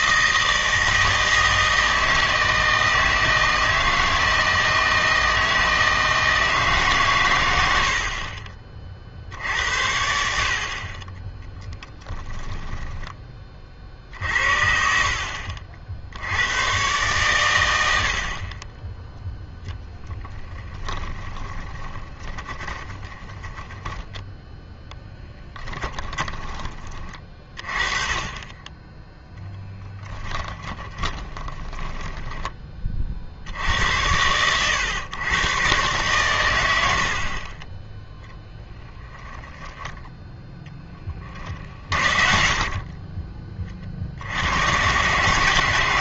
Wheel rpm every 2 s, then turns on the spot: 160, 160, 160, 140, 50, 40, 10, 50, 110, 20, 20, 20, 10, 30, 10, 20, 30, 110, 80, 10, 10, 30, 110.
12-14 20-24 30-32